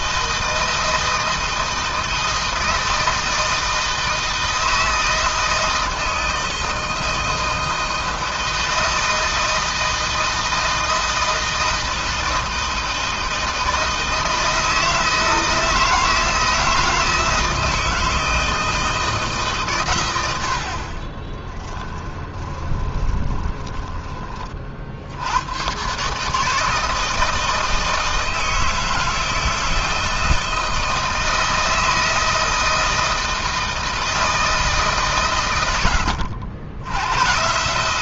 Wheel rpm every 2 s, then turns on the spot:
160, 160, 160, 160, 170, 160, 160, 160, 160, 160, 50, 20, 70, 160, 160, 160, 160, 140, 100.
22-24